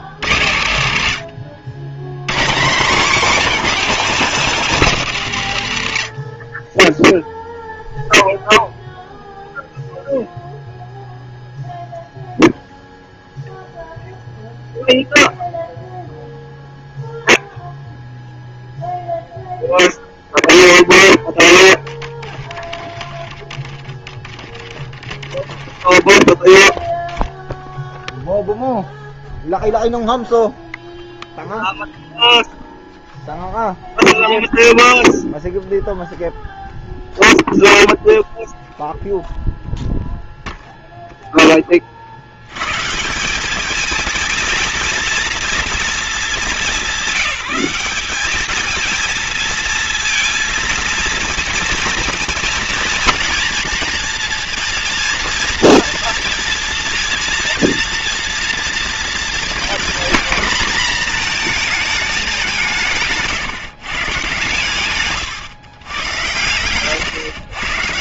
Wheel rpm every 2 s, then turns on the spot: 110, 190, 220, 10, 0, 0, 0, 0, 0, 0, 0, 20, 30, 10, 0, 0, 0, 0, 0, 0, 0, 130, 230, 200, 220, 230, 230, 230, 230, 230, 230, 150, 130, 130.
none